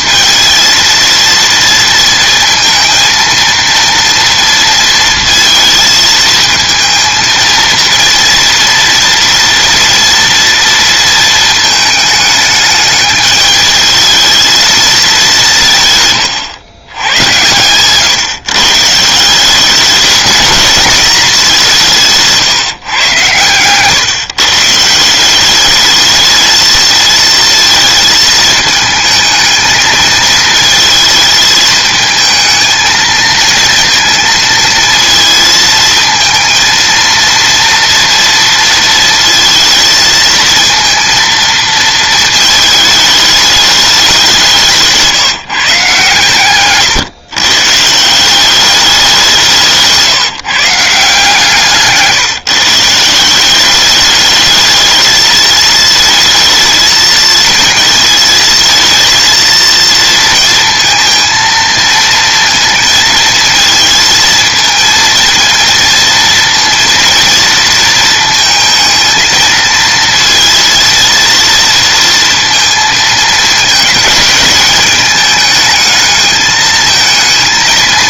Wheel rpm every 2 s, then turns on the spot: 230, 230, 230, 230, 230, 230, 210, 220, 110, 150, 220, 140, 160, 230, 220, 220, 220, 230, 230, 230, 230, 220, 160, 130, 200, 150, 160, 220, 220, 230, 230, 230, 230, 230, 230, 230, 230, 210, 220.
none